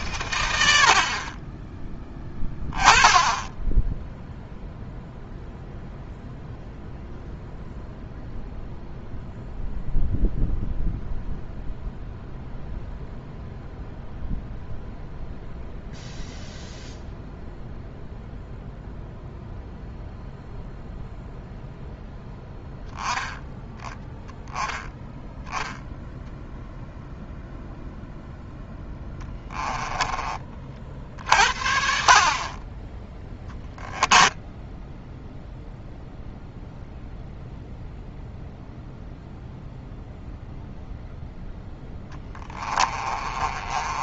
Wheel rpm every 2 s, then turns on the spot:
50, 10, 0, 0, 0, 0, 0, 0, 0, 0, 0, 0, 10, 0, 10, 50, 10, 0, 0, 0, 0, 20.
28-30 42-44